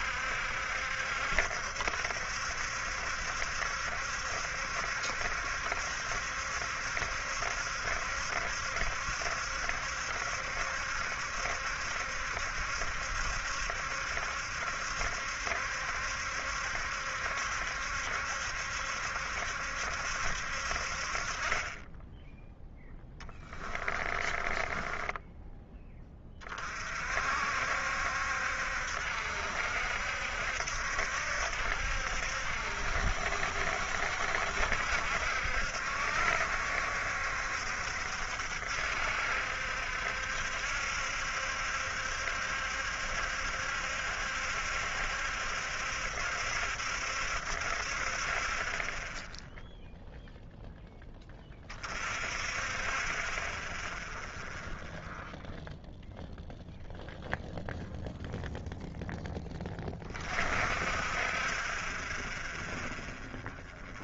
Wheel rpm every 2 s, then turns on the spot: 70, 70, 70, 70, 70, 70, 70, 70, 70, 70, 50, 10, 20, 50, 70, 70, 70, 70, 70, 70, 70, 70, 70, 70, 30, 0, 30, 0, 0, 0, 40, 0.
24-26